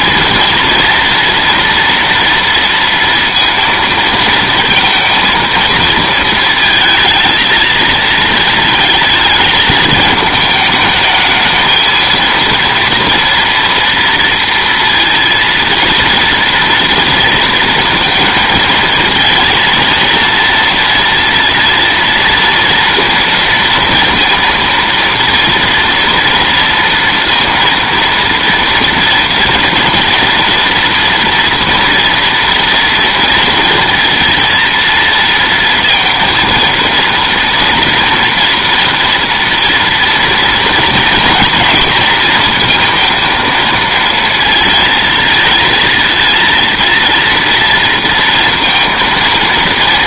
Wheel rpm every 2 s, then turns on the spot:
230, 230, 230, 220, 220, 220, 230, 230, 230, 230, 230, 230, 230, 230, 230, 230, 230, 230, 230, 230, 240, 230, 230, 230, 230.
none